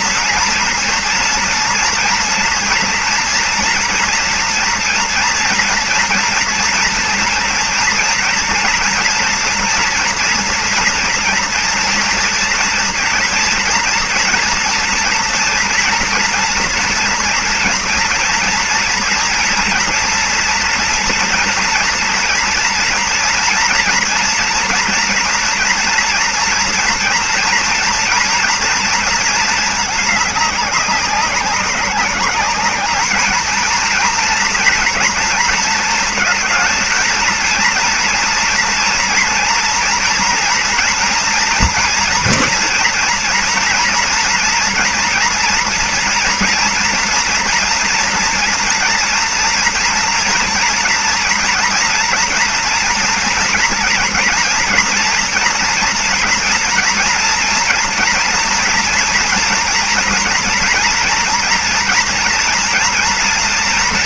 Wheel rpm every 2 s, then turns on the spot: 230, 230, 230, 240, 230, 230, 230, 230, 240, 230, 230, 230, 230, 230, 240, 210, 200, 230, 230, 240, 230, 230, 240, 240, 240, 230, 230, 230, 230, 240, 230, 240.
none